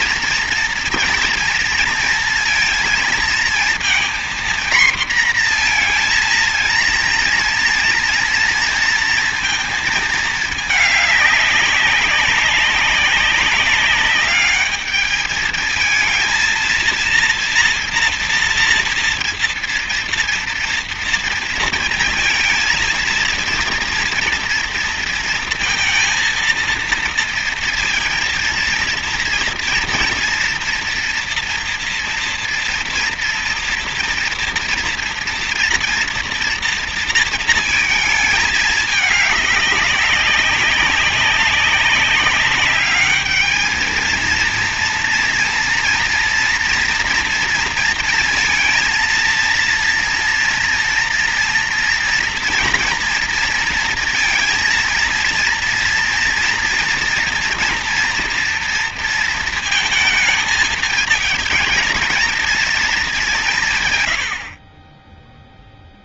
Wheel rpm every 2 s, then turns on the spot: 230, 230, 240, 230, 230, 210, 190, 210, 230, 230, 230, 230, 230, 230, 230, 230, 230, 230, 230, 210, 190, 210, 230, 230, 230, 230, 230, 230, 230, 230, 220, 210, 30.
none